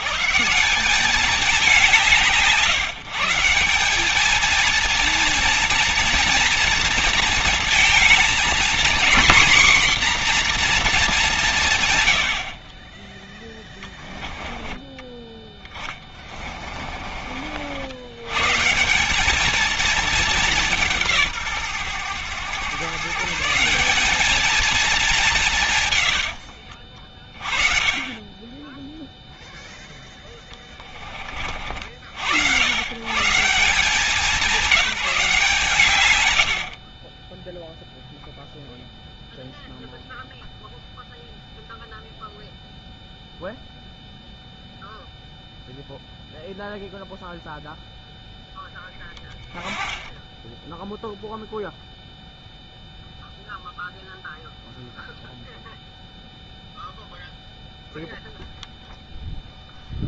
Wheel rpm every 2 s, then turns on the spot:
120, 140, 210, 230, 230, 250, 100, 10, 30, 130, 210, 120, 220, 80, 20, 20, 90, 180, 90, 0, 0, 0, 0, 0, 0, 10, 0, 0, 0, 0.
16-18 26-28 30-32